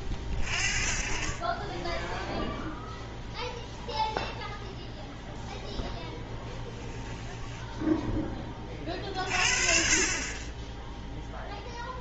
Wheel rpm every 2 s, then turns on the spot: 40, 0, 0, 10, 30, 20.
6-8